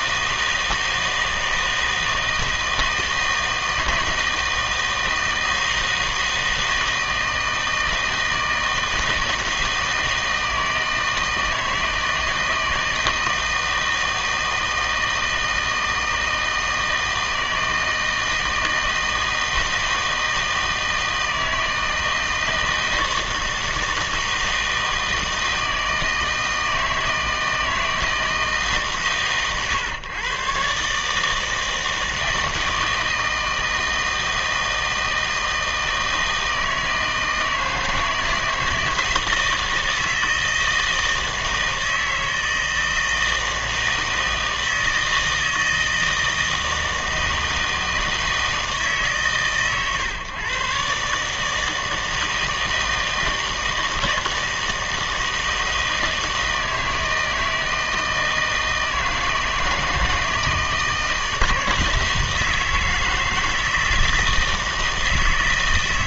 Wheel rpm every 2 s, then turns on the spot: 160, 160, 160, 160, 160, 160, 160, 160, 160, 160, 160, 160, 160, 160, 150, 130, 160, 160, 160, 160, 160, 160, 160, 160, 160, 130, 160, 160, 160, 160, 160, 160, 160.
none